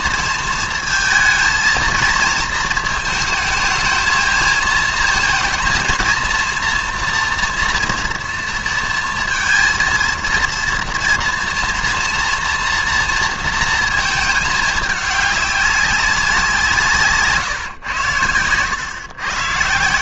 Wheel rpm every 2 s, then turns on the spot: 230, 230, 230, 230, 230, 230, 230, 220, 170, 100.
none